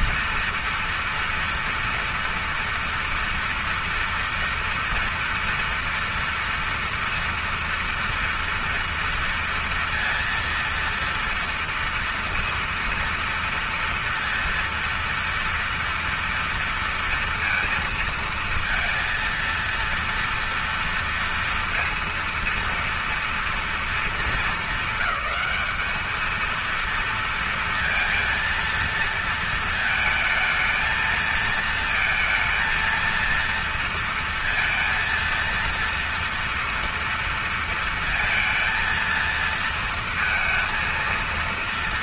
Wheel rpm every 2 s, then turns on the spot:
230, 230, 230, 230, 240, 230, 230, 230, 230, 230, 230, 230, 220, 230, 230, 220, 230, 230, 240, 230, 230.
none